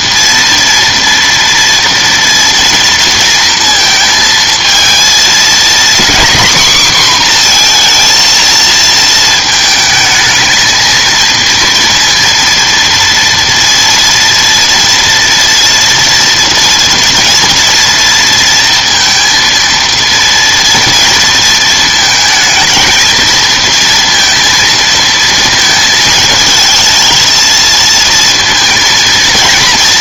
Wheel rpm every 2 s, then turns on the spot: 230, 230, 220, 250, 230, 220, 240, 230, 230, 230, 230, 220, 230, 220, 230.
none